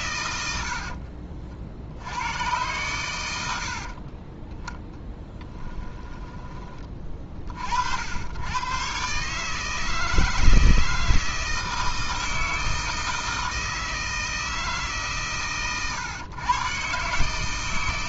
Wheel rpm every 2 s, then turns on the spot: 70, 120, 10, 20, 110, 160, 160, 160, 130.
none